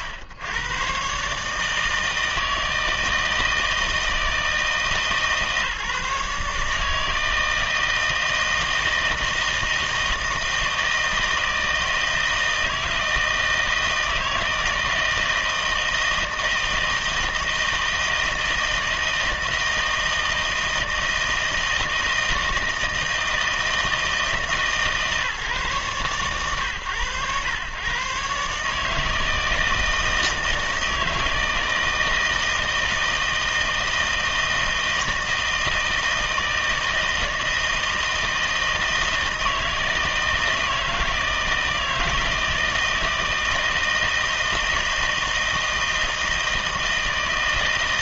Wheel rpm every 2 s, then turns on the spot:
100, 160, 160, 150, 160, 160, 160, 160, 160, 160, 160, 160, 160, 110, 150, 160, 160, 160, 160, 160, 160, 160, 160, 160.
none